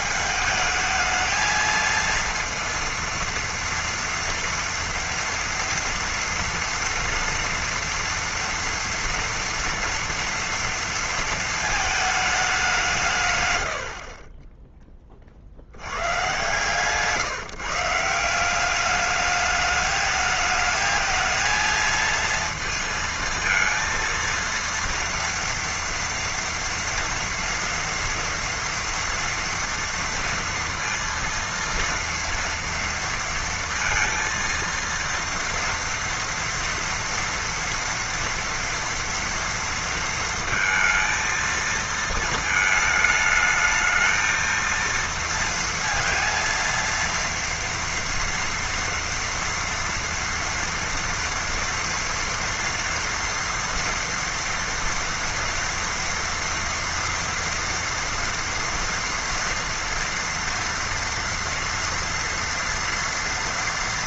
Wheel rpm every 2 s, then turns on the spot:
220, 230, 230, 230, 230, 230, 200, 20, 140, 190, 220, 220, 230, 230, 230, 230, 230, 230, 230, 230, 230, 220, 230, 230, 240, 230, 240, 230, 230, 240, 230, 240.
14-16